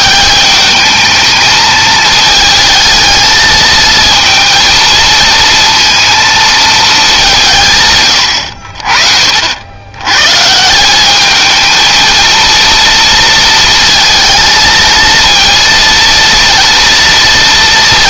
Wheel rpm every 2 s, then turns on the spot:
210, 220, 230, 210, 50, 180, 230, 230, 230.
none